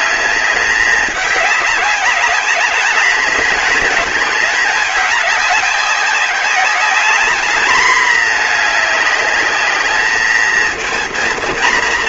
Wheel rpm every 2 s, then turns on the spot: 200, 210, 210, 200, 210, 220.
none